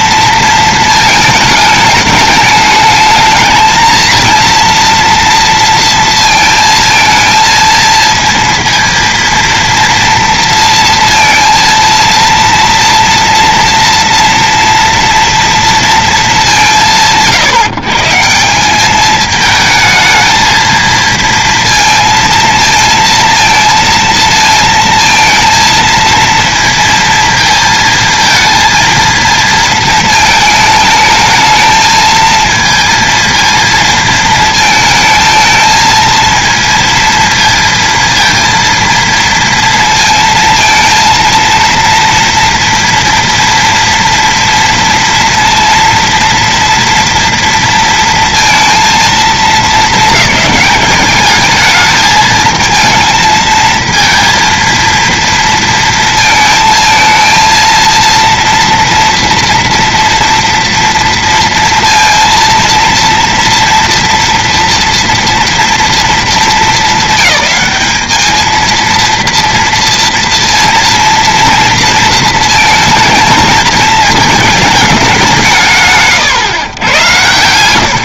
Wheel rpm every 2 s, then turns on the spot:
230, 210, 230, 230, 230, 230, 230, 230, 170, 180, 220, 230, 230, 230, 230, 220, 220, 220, 230, 230, 230, 230, 230, 230, 230, 210, 220, 230, 230, 230, 240, 230, 230, 230, 220, 230, 220, 220, 120.
none